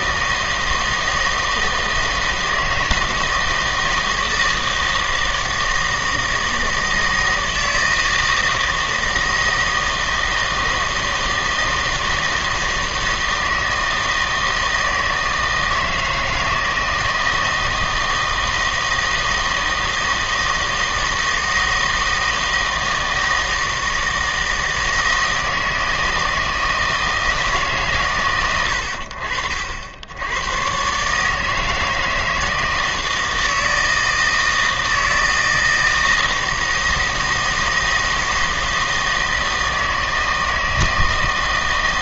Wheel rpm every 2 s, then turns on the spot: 160, 160, 160, 160, 160, 160, 160, 160, 160, 160, 160, 160, 160, 160, 60, 130, 160, 160, 160, 160, 160.
none